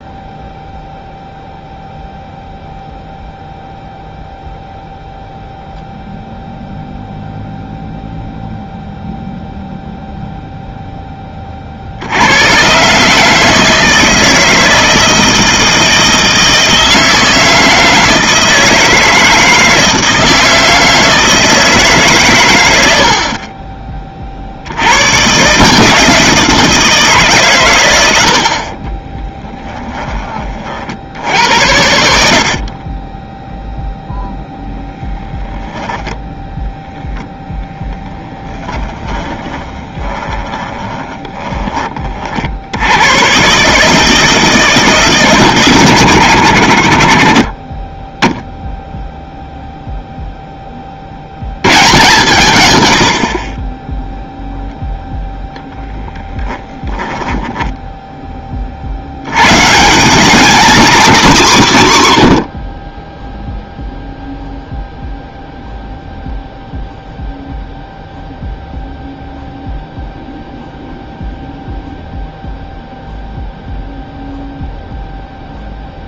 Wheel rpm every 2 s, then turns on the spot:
0, 0, 0, 0, 0, 0, 130, 160, 160, 160, 160, 90, 80, 170, 40, 50, 30, 0, 0, 20, 20, 80, 160, 80, 0, 20, 120, 0, 10, 40, 230, 20, 0, 0, 0, 0, 0, 0.
28-30 32-34 38-42 56-58